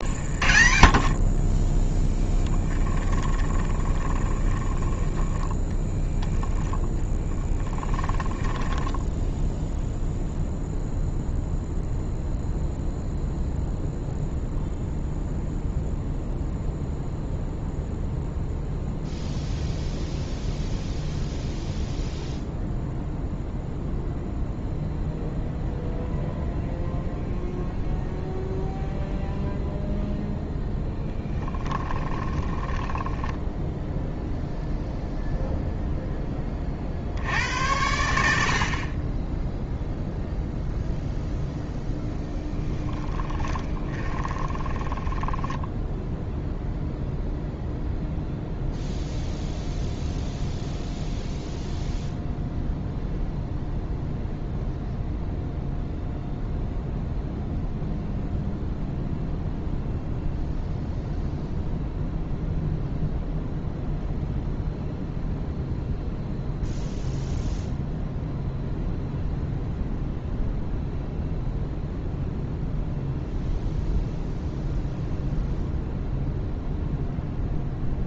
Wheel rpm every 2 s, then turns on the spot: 0, 0, 0, 40, 50, 10, 10, 10, 0, 0, 0, 0, 0, 0, 0, 10, 10, 0, 50, 40, 0, 10, 20, 0, 0, 0, 0, 0, 0, 0, 0, 0, 0, 0, 0, 0, 0, 0, 0.
8-12 30-34 42-46